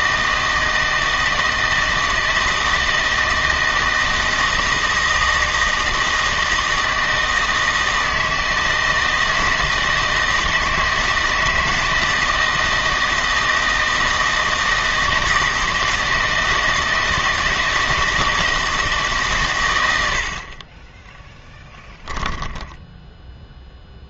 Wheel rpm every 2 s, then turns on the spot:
160, 160, 160, 160, 160, 160, 160, 160, 160, 160, 30, 10.
22-24